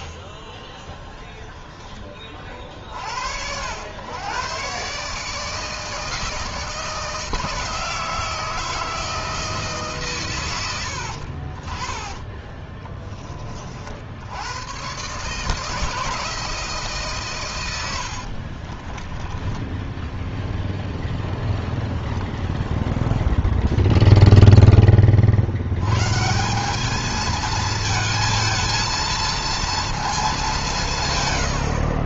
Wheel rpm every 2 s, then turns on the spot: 20, 40, 130, 160, 160, 100, 10, 100, 160, 40, 0, 0, 10, 180, 220, 190.
12-14 18-20